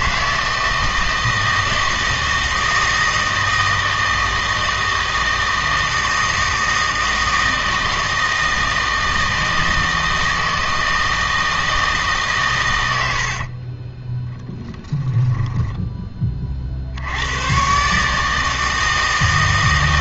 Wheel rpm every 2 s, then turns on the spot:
160, 160, 160, 160, 160, 160, 120, 10, 50, 160.
14-16